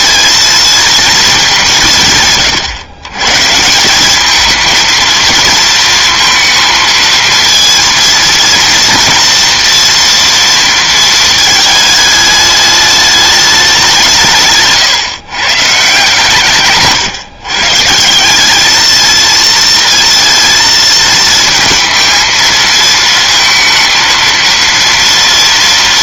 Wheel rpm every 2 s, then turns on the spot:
230, 120, 230, 230, 230, 230, 210, 150, 140, 210, 220, 220, 230.
none